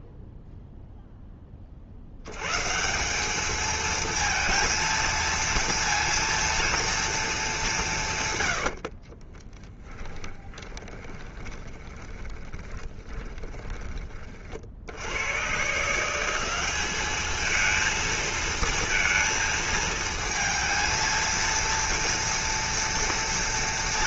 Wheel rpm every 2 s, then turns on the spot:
0, 140, 230, 230, 80, 20, 20, 40, 190, 230, 230, 240.
8-14